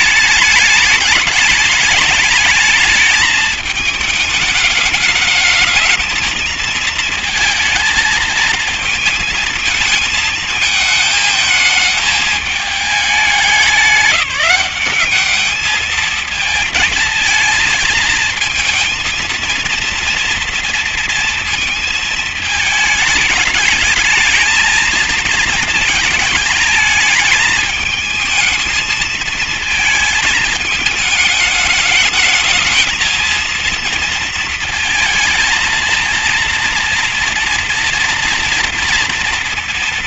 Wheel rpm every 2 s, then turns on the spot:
210, 220, 210, 220, 220, 220, 210, 180, 220, 220, 230, 220, 210, 210, 220, 220, 220, 230, 230, 230.
none